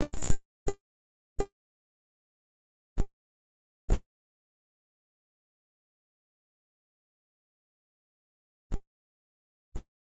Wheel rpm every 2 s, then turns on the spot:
0, 0, 0, 0, 0.
none